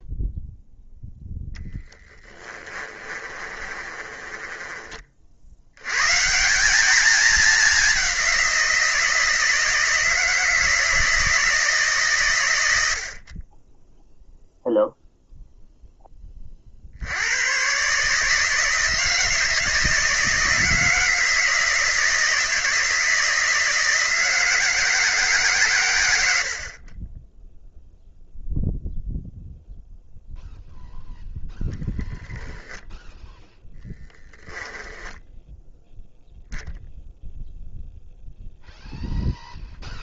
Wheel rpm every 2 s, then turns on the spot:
0, 20, 30, 200, 170, 160, 70, 0, 60, 170, 160, 160, 160, 40, 0, 0, 10, 10, 10, 0.
2-4 34-36